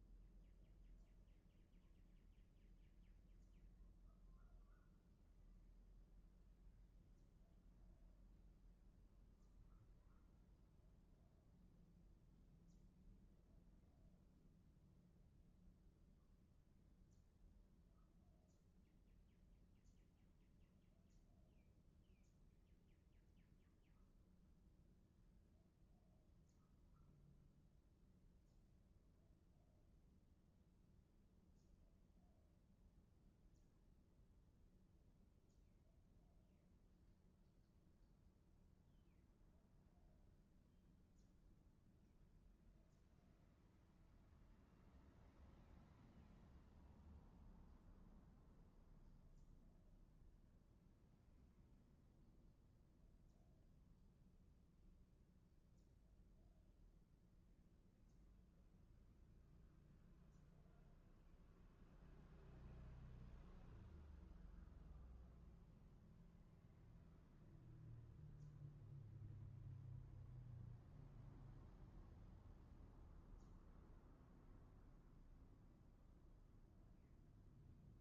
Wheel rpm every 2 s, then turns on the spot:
0, 0, 0, 0, 0, 0, 0, 0, 0, 0, 0, 0, 0, 0, 0, 0, 0, 0, 0, 0, 0, 0, 0, 0, 0, 0, 0, 0, 0, 0, 0, 0, 0, 0, 0, 0, 0, 0, 0.
none